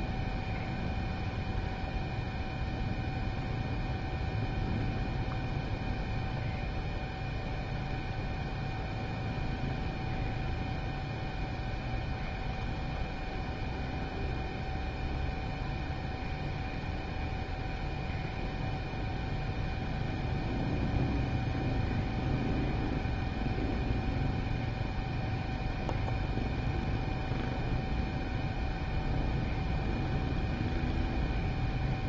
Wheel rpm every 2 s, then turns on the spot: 0, 0, 0, 0, 0, 0, 0, 0, 0, 0, 0, 0, 0, 0, 0, 0.
none